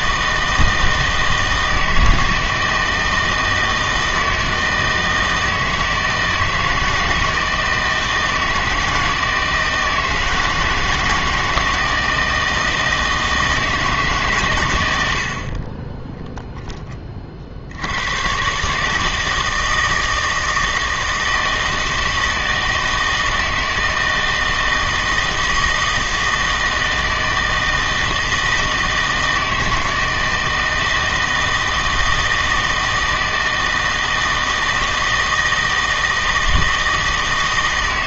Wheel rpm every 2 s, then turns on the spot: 160, 160, 160, 160, 160, 160, 160, 110, 10, 140, 160, 160, 160, 160, 160, 160, 160, 160, 160.
none